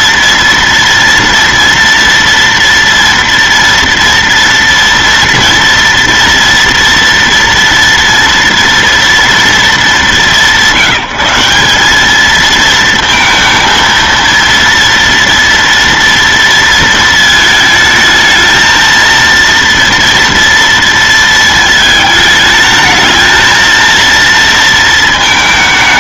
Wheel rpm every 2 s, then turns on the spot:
230, 230, 230, 230, 230, 190, 220, 230, 230, 220, 230, 220, 230.
none